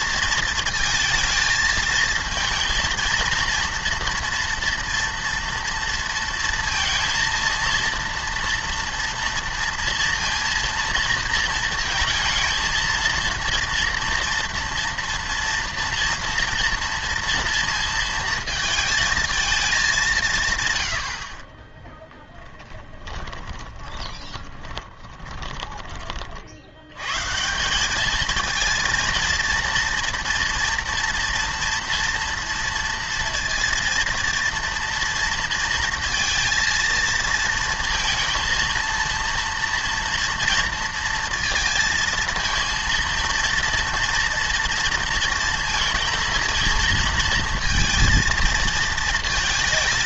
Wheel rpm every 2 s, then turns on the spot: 230, 230, 230, 230, 230, 230, 230, 230, 230, 220, 120, 20, 20, 90, 230, 230, 230, 230, 230, 230, 230, 230, 230, 220, 230.
22-26